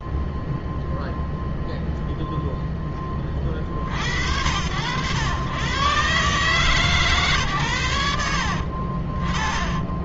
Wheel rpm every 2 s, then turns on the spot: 0, 0, 80, 150, 50.
none